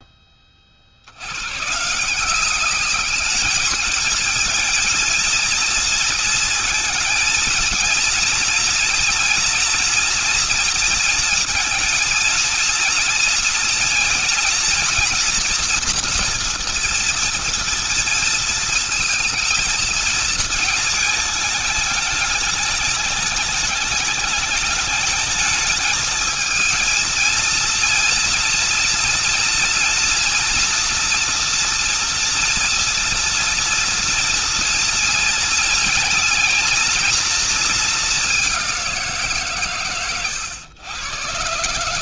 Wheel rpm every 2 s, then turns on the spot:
50, 190, 230, 230, 230, 230, 230, 230, 230, 230, 220, 210, 210, 220, 230, 240, 240, 240, 230, 200, 110.
none